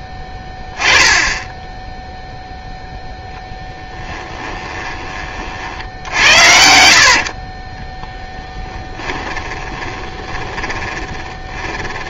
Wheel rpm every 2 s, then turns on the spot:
0, 0, 20, 50, 10, 20.
6-12